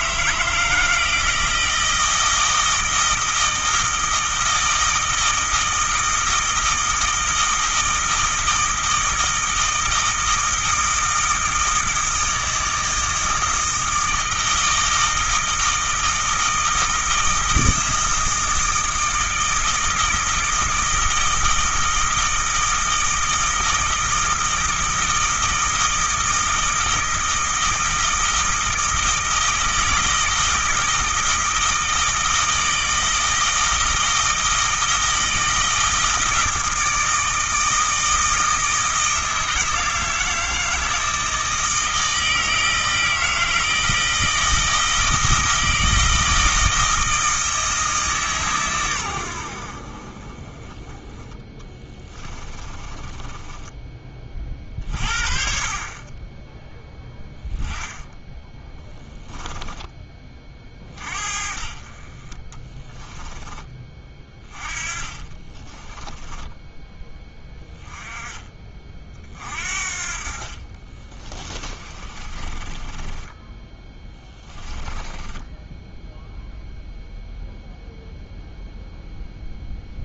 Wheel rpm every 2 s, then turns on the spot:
160, 160, 160, 160, 160, 160, 160, 160, 160, 160, 160, 160, 160, 160, 160, 160, 160, 160, 160, 160, 160, 160, 160, 160, 120, 20, 30, 40, 10, 10, 40, 10, 20, 10, 30, 40, 20, 10, 0, 0.
52-54 58-60 62-68 70-76